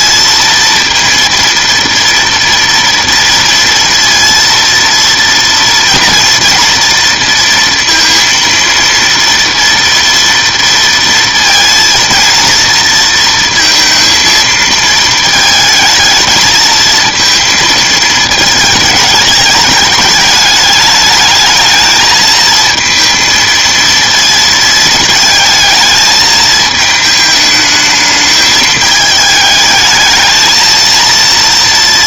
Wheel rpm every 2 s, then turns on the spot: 230, 230, 230, 230, 230, 230, 230, 220, 220, 220, 210, 230, 220, 220, 210, 230.
none